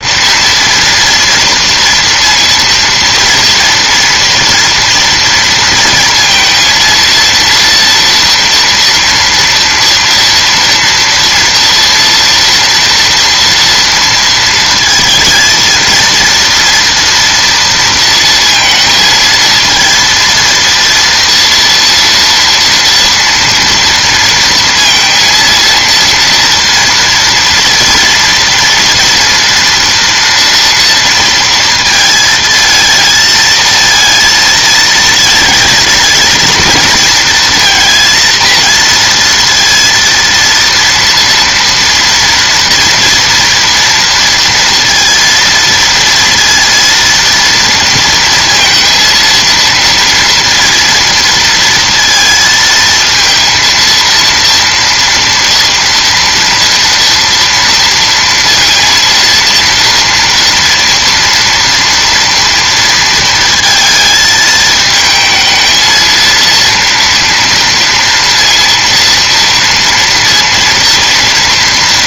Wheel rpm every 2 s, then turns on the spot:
230, 230, 230, 230, 230, 230, 230, 220, 240, 230, 230, 230, 230, 230, 230, 230, 220, 220, 230, 230, 230, 230, 230, 230, 230, 230, 230, 230, 230, 230, 230, 230, 220, 230, 230, 230.
none